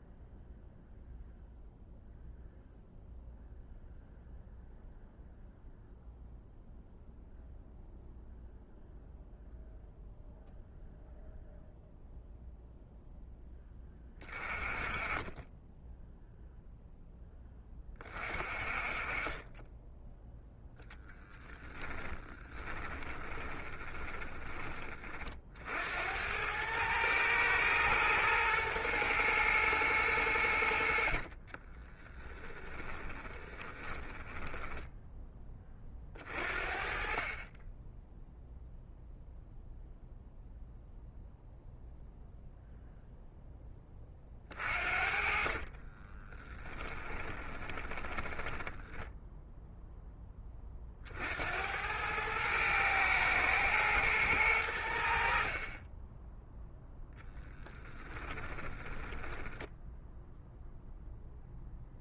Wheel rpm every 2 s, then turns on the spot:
0, 0, 0, 0, 0, 0, 0, 20, 0, 30, 10, 20, 40, 110, 120, 60, 10, 10, 40, 0, 0, 0, 40, 10, 10, 50, 110, 80, 0, 10, 0.
22-24 30-36 44-48 58-60